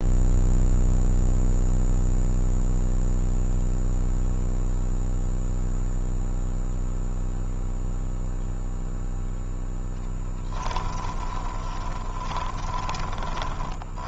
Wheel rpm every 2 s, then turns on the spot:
0, 0, 0, 0, 0, 20, 20.
10-14